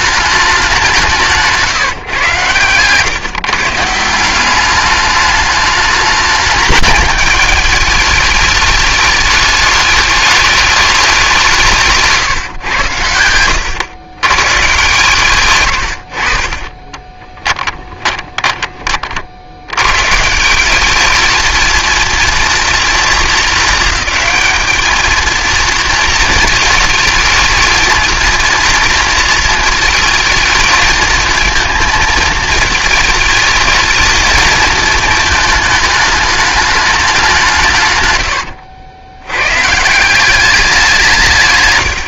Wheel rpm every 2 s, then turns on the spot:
190, 130, 200, 210, 210, 210, 120, 140, 30, 40, 200, 230, 220, 220, 230, 220, 220, 220, 210, 100, 180.
16-18